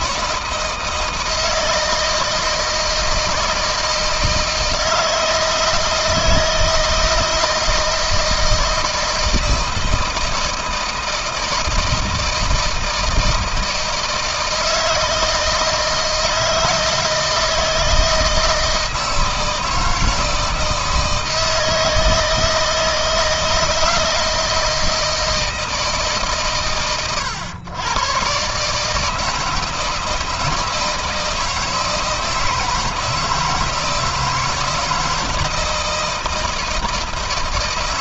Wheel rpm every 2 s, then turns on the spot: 160, 160, 160, 160, 160, 160, 160, 160, 160, 170, 160, 160, 160, 120, 130, 160, 160, 160, 160.
none